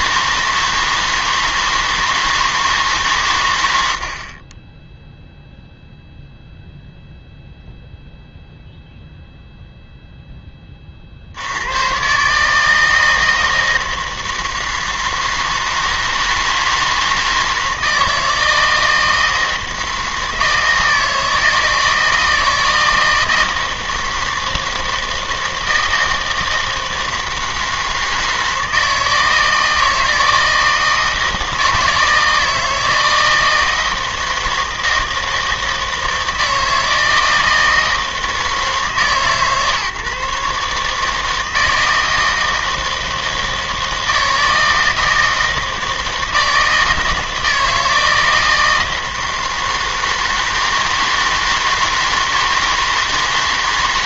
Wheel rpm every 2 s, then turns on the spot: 160, 160, 20, 0, 0, 20, 150, 160, 160, 160, 160, 160, 160, 160, 160, 160, 160, 160, 160, 160, 150, 160, 160, 160, 160, 160, 160.
none